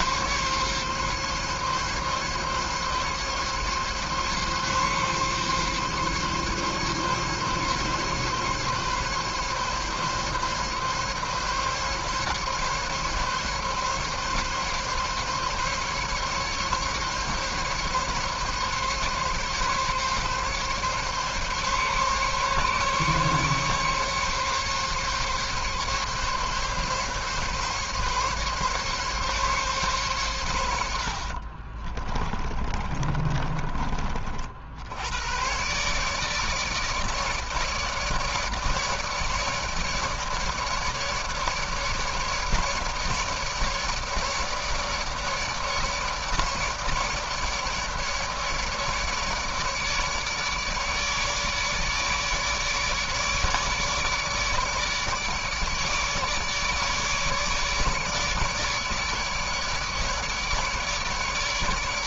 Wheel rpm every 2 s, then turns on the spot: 140, 140, 140, 140, 140, 140, 140, 140, 140, 140, 140, 140, 140, 140, 140, 80, 30, 90, 150, 150, 150, 150, 150, 150, 150, 150, 150, 150, 150, 150, 150.
30-34